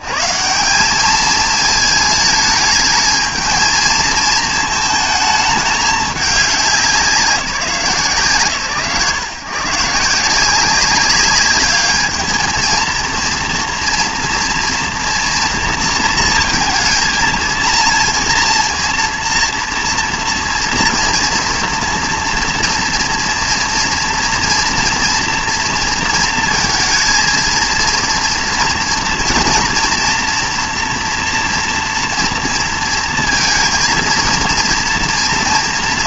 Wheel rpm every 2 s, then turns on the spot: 130, 220, 220, 200, 130, 180, 220, 230, 230, 230, 230, 230, 230, 230, 230, 230, 230, 230.
none